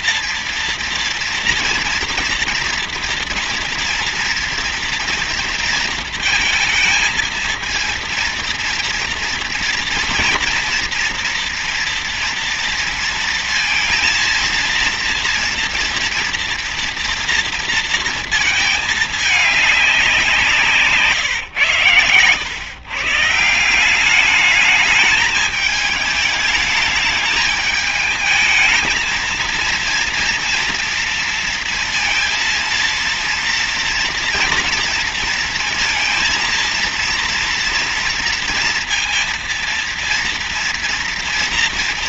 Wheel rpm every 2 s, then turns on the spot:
230, 230, 230, 230, 230, 240, 230, 230, 230, 220, 170, 120, 210, 210, 220, 230, 230, 230, 230, 230, 230.
none